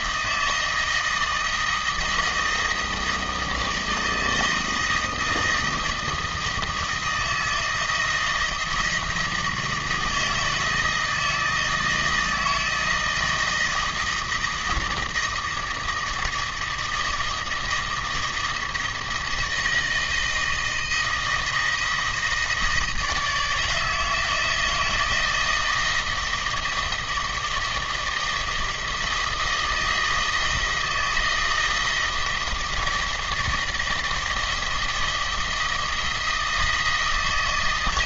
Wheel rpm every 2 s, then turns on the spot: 160, 160, 160, 160, 160, 160, 160, 160, 160, 160, 170, 160, 160, 160, 160, 160, 160, 160, 160.
none